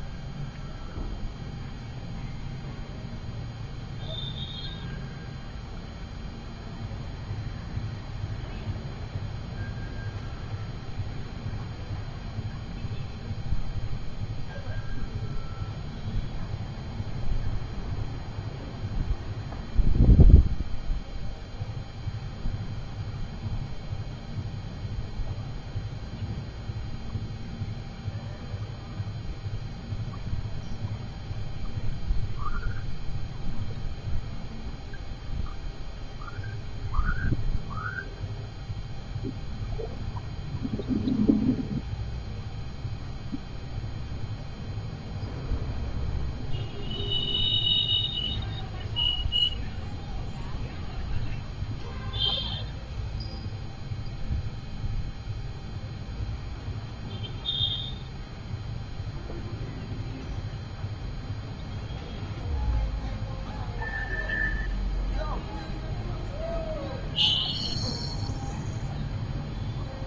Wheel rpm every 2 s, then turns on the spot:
0, 0, 0, 0, 0, 0, 0, 0, 0, 0, 0, 0, 0, 0, 0, 0, 0, 0, 0, 0, 0, 0, 0, 0, 0, 0, 0, 0, 0, 0, 0, 0, 0, 0, 0.
none